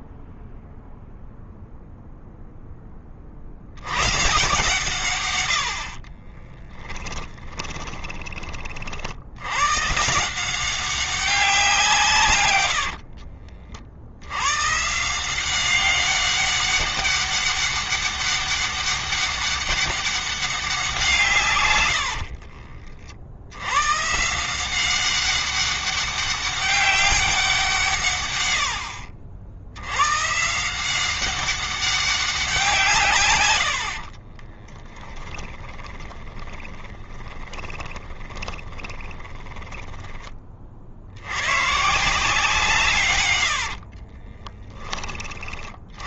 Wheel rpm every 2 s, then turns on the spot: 0, 20, 130, 20, 40, 180, 100, 140, 200, 200, 190, 80, 180, 200, 90, 170, 170, 20, 20, 20, 40, 150, 20.
6-8 12-14 34-40